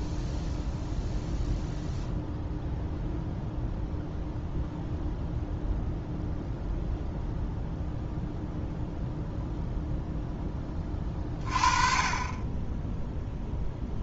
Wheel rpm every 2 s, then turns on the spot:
0, 0, 0, 0, 0, 20, 10.
none